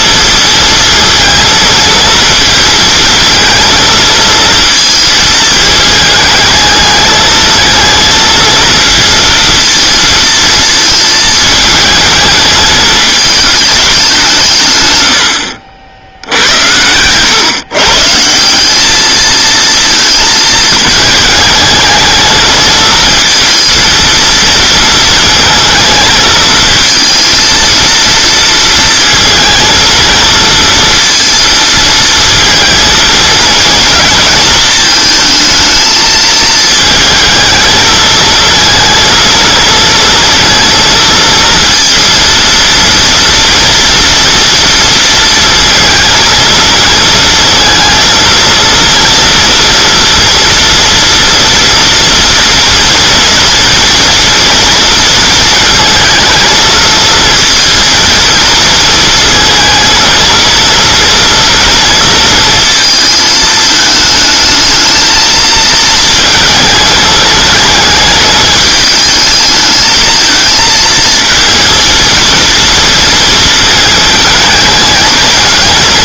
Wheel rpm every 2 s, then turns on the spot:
230, 230, 230, 210, 230, 220, 210, 130, 100, 190, 220, 220, 230, 220, 230, 230, 220, 220, 220, 230, 230, 230, 230, 230, 230, 230, 240, 230, 230, 230, 230, 230, 220, 220, 220, 220, 230, 220.
none